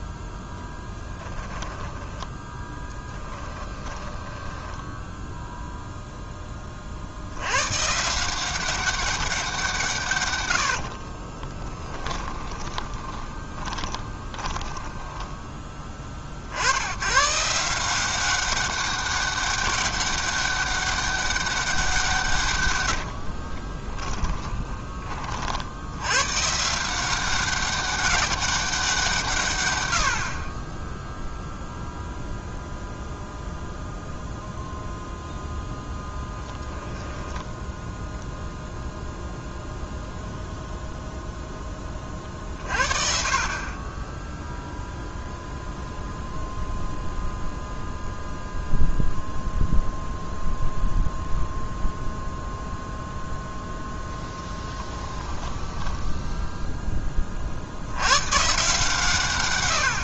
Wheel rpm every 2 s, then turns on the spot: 0, 10, 10, 20, 190, 90, 20, 20, 100, 200, 200, 130, 30, 170, 180, 10, 0, 0, 10, 0, 0, 40, 0, 0, 0, 0, 0, 10, 10, 140.
2-6 10-16 22-26 36-38 54-56